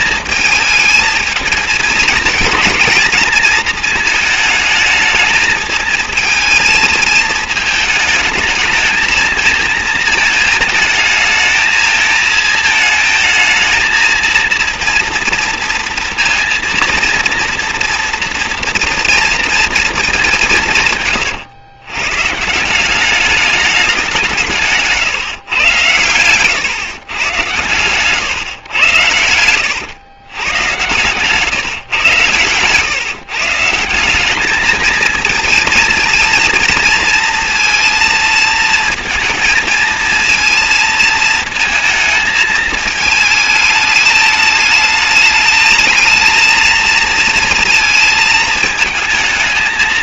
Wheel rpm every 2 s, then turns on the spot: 220, 230, 220, 220, 220, 220, 220, 240, 230, 230, 150, 190, 140, 130, 100, 130, 130, 220, 230, 230, 230, 220, 220, 230, 220.
24-26